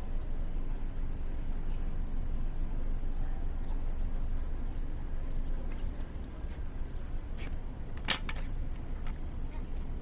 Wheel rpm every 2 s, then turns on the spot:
0, 0, 0, 0, 0.
none